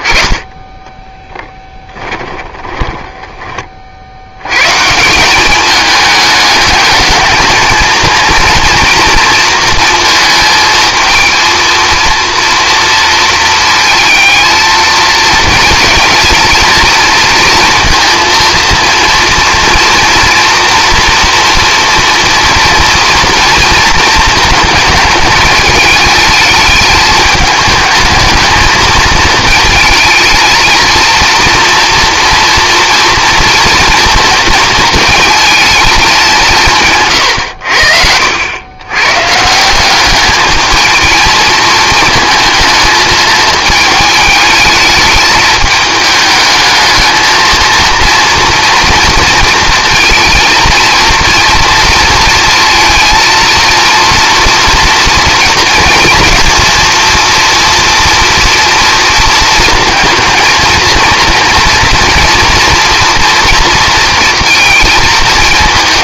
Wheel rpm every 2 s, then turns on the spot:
10, 10, 110, 210, 230, 220, 230, 220, 230, 230, 240, 230, 220, 210, 230, 220, 240, 230, 170, 90, 210, 220, 210, 220, 230, 230, 230, 230, 230, 230, 230, 230, 230.
0-4